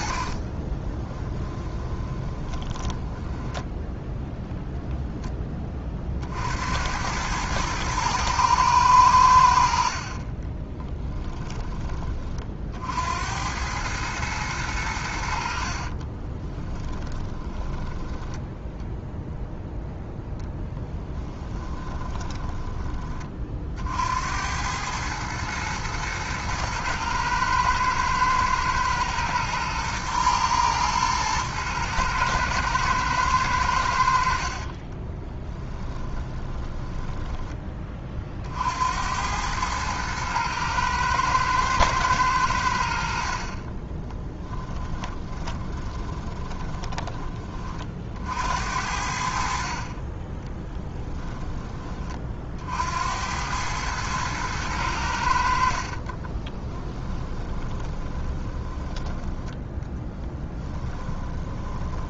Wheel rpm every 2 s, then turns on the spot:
20, 10, 0, 80, 110, 20, 60, 100, 10, 0, 10, 20, 100, 110, 120, 110, 110, 40, 10, 70, 110, 80, 20, 20, 70, 20, 60, 100, 20, 20, 20.
0-4 10-12 16-18 20-22 34-38 44-48 50-52 56-62